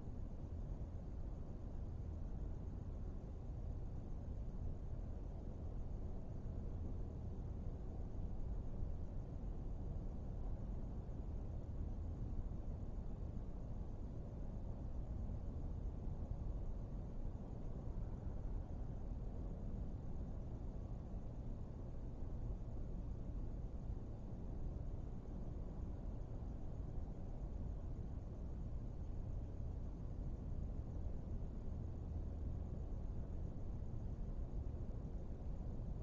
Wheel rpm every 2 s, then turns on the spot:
0, 0, 0, 0, 0, 0, 0, 0, 0, 0, 0, 0, 0, 0, 0, 0, 0, 0.
none